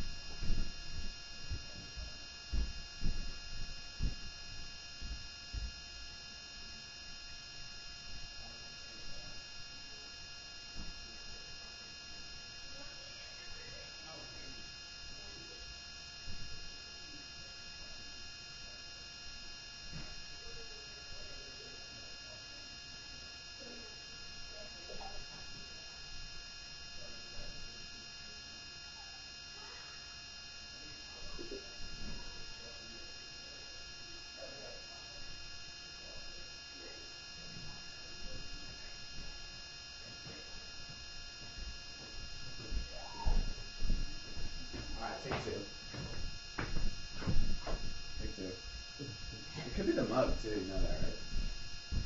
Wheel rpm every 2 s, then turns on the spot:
0, 0, 0, 0, 0, 0, 0, 0, 0, 0, 0, 0, 0, 0, 0, 0, 0, 0, 0, 0, 0, 0, 0, 0, 0, 0.
none